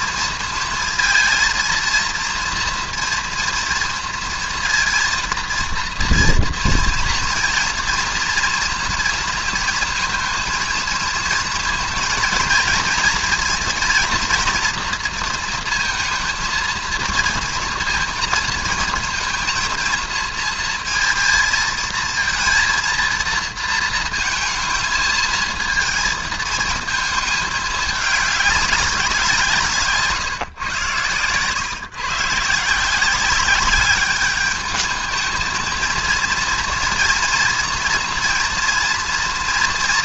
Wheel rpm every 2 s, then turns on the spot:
230, 240, 230, 230, 230, 230, 230, 230, 230, 230, 230, 230, 220, 220, 200, 130, 160, 210, 230, 230.
none